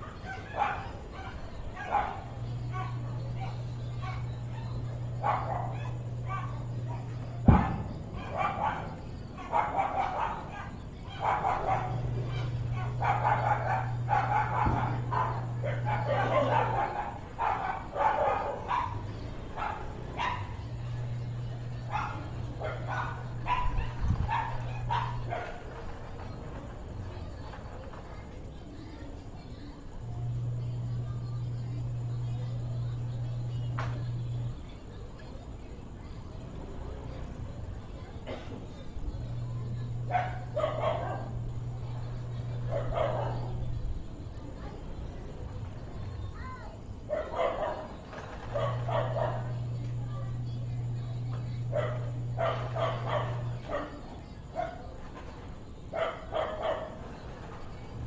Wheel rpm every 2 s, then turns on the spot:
0, 0, 0, 0, 0, 0, 0, 0, 0, 0, 0, 0, 0, 0, 0, 0, 0, 0, 0, 0, 0, 0, 0, 0, 0, 0, 0, 0, 0.
none